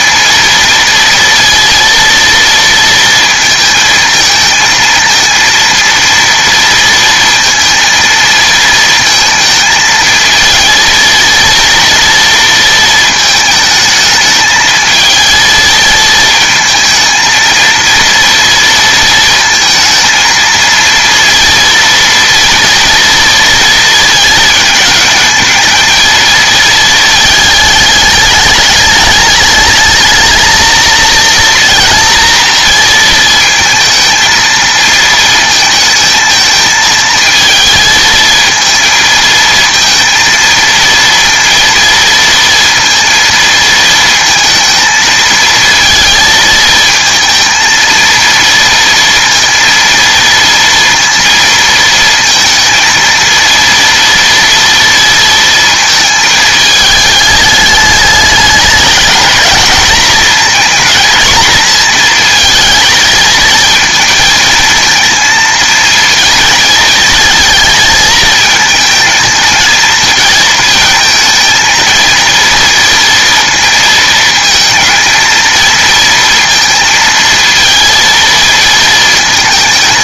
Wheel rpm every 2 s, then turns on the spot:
230, 230, 220, 230, 220, 230, 220, 220, 220, 230, 230, 230, 220, 220, 210, 220, 230, 220, 220, 230, 230, 230, 220, 230, 230, 230, 230, 230, 210, 210, 240, 220, 220, 220, 220, 220, 230, 230, 230, 230.
none